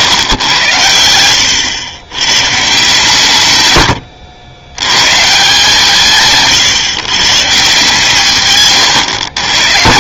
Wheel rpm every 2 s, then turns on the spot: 100, 130, 90, 140, 130.
8-10